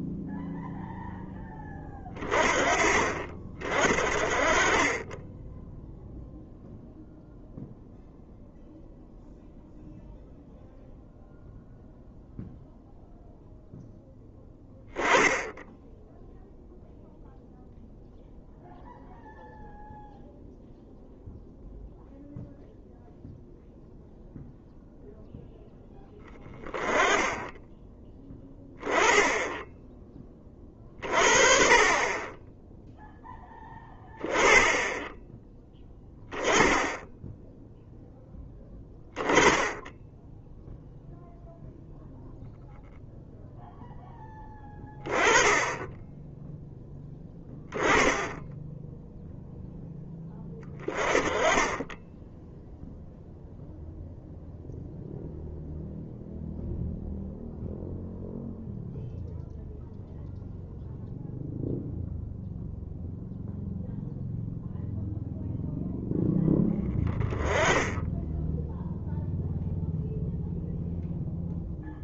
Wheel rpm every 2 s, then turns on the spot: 0, 40, 30, 0, 0, 0, 0, 20, 0, 0, 0, 0, 0, 10, 10, 30, 10, 10, 10, 20, 0, 0, 20, 10, 10, 20, 0, 0, 0, 0, 0, 0, 0, 10, 0, 0.
none